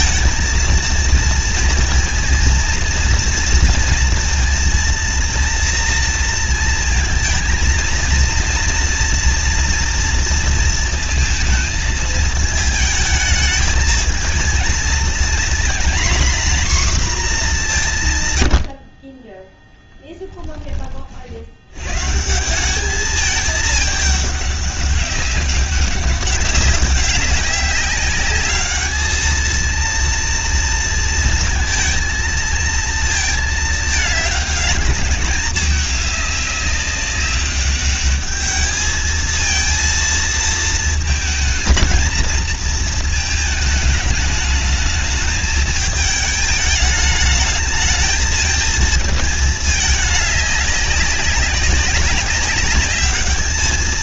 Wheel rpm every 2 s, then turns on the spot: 230, 230, 230, 230, 230, 230, 220, 230, 250, 80, 20, 180, 200, 200, 210, 230, 230, 210, 200, 210, 220, 230, 210, 210, 220, 200, 200.
none